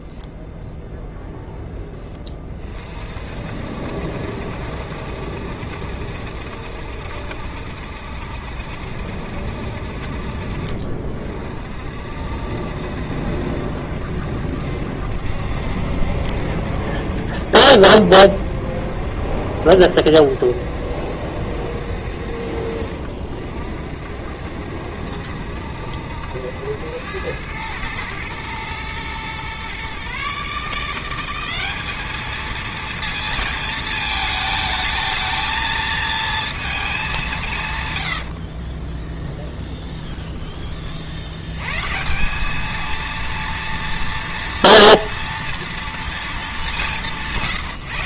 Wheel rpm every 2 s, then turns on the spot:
10, 60, 70, 70, 60, 50, 70, 70, 70, 70, 70, 50, 70, 100, 120, 190, 230, 220, 190, 10, 60, 230, 230, 150.
38-40